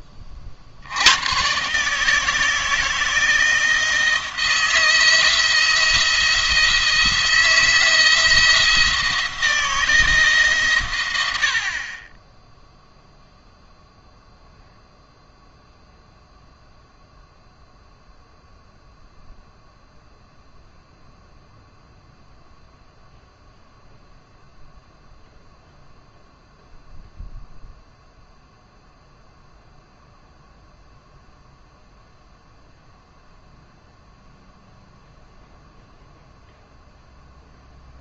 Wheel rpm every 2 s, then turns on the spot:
60, 160, 170, 160, 160, 130, 0, 0, 0, 0, 0, 0, 0, 0, 0, 0, 0, 0, 0.
none